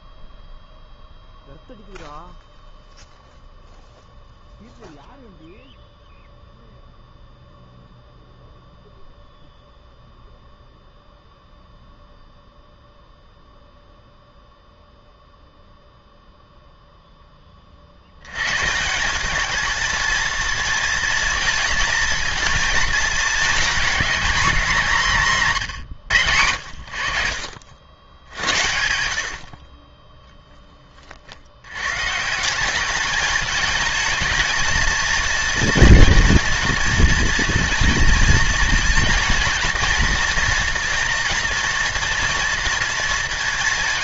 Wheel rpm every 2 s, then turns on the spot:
0, 0, 0, 0, 0, 0, 0, 0, 0, 140, 230, 230, 240, 80, 60, 30, 190, 220, 220, 230, 230, 230.
none